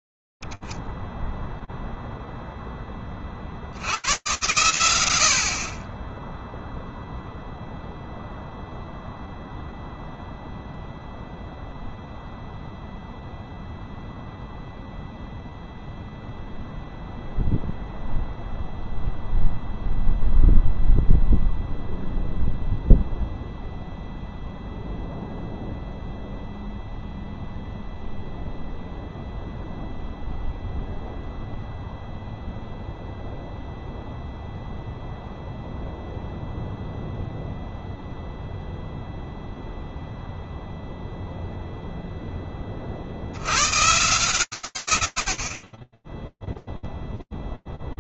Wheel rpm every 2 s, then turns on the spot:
0, 0, 50, 30, 0, 0, 0, 0, 0, 0, 0, 0, 0, 0, 0, 0, 0, 0, 0, 0, 0, 70, 100, 0.
none